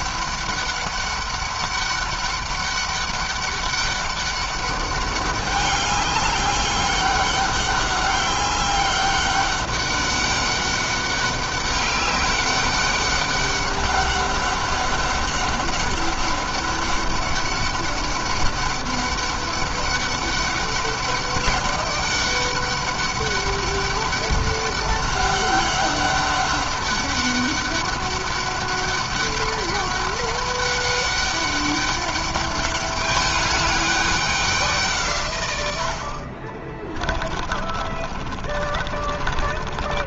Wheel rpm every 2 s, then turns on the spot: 200, 200, 200, 200, 200, 200, 200, 200, 200, 200, 200, 200, 200, 200, 200, 200, 200, 170, 30, 30.
36-40